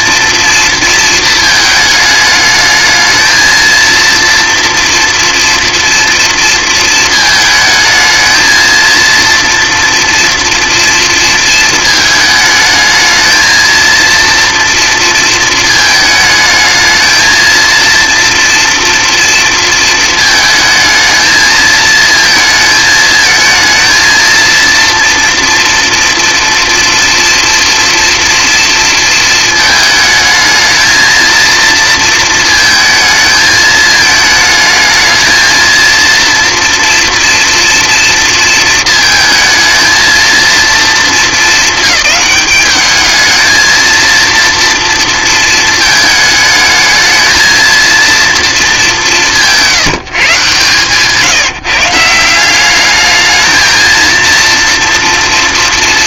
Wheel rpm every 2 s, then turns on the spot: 230, 220, 230, 230, 230, 230, 220, 230, 220, 230, 220, 220, 230, 230, 230, 220, 220, 220, 230, 230, 230, 200, 230, 220, 210, 150, 200, 230.
none